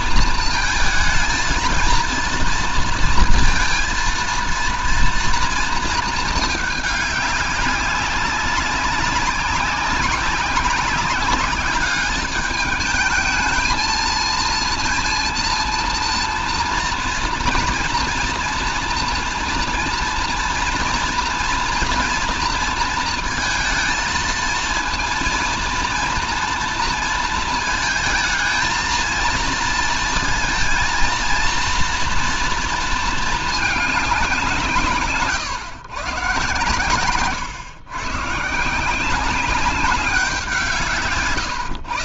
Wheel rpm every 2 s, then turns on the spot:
220, 230, 230, 210, 200, 200, 210, 230, 230, 230, 230, 230, 230, 230, 230, 230, 230, 160, 130, 150, 160.
none